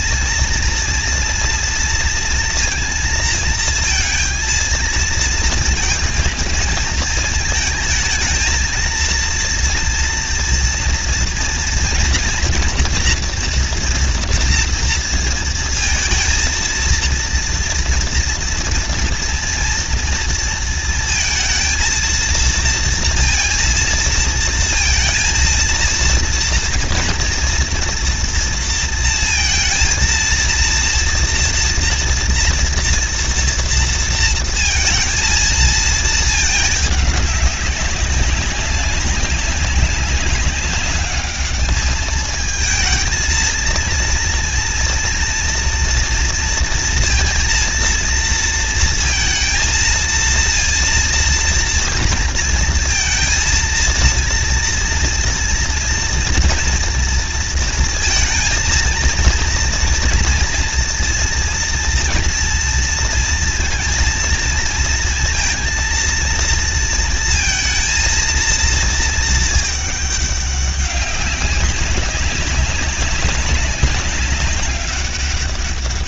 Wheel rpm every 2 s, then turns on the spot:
230, 230, 230, 230, 230, 230, 240, 230, 230, 230, 230, 230, 230, 230, 230, 230, 230, 230, 220, 200, 200, 220, 240, 230, 230, 230, 230, 230, 230, 230, 230, 230, 230, 230, 230, 200, 200, 200.
none